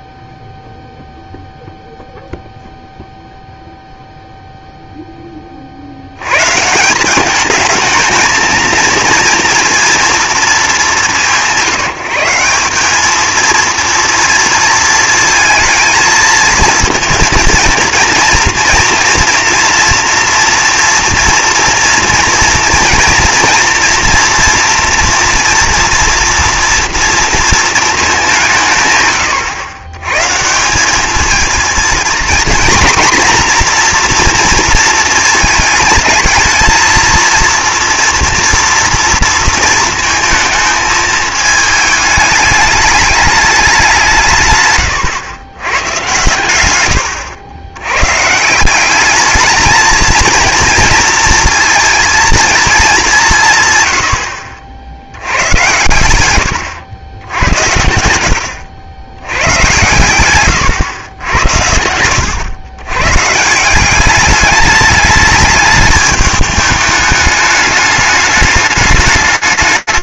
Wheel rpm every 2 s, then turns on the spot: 0, 0, 0, 150, 230, 210, 190, 230, 230, 230, 240, 230, 240, 230, 160, 170, 240, 230, 230, 230, 220, 210, 120, 120, 180, 220, 220, 70, 100, 90, 110, 110, 200, 210, 210.
60-62